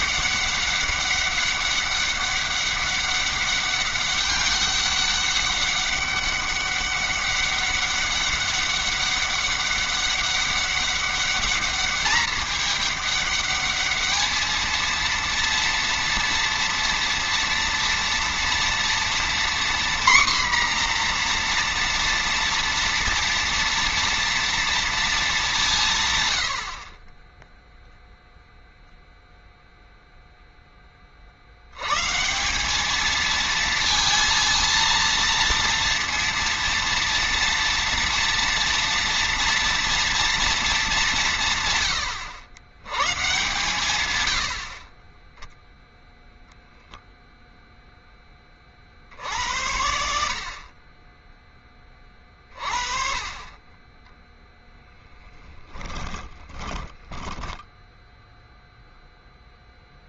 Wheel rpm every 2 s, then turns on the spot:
200, 200, 200, 200, 200, 200, 210, 220, 230, 230, 250, 230, 230, 90, 0, 10, 180, 230, 230, 240, 230, 100, 80, 0, 30, 50, 30, 10, 20, 0.
56-58